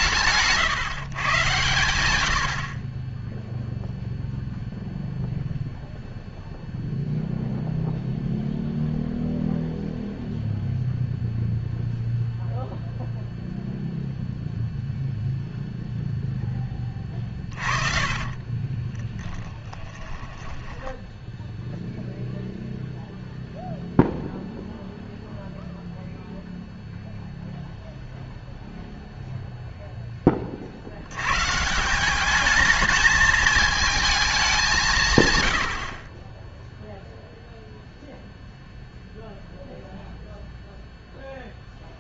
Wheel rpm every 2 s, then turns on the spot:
140, 20, 0, 0, 0, 0, 0, 0, 20, 20, 10, 0, 0, 0, 0, 70, 220, 180, 0, 0, 0.
16-22